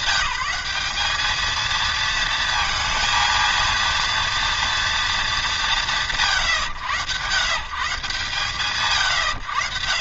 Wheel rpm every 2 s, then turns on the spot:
190, 230, 240, 110, 120.
none